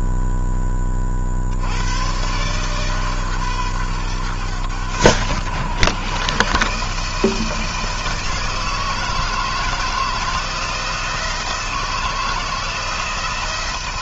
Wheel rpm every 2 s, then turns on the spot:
20, 140, 110, 150, 160, 160, 160.
none